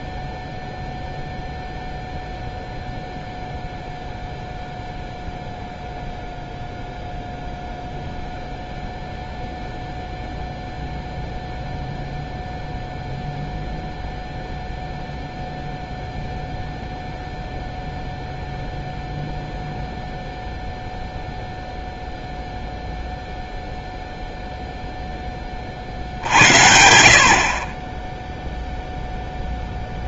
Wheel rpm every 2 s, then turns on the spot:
0, 0, 0, 0, 0, 0, 0, 0, 0, 0, 0, 0, 0, 70, 0.
none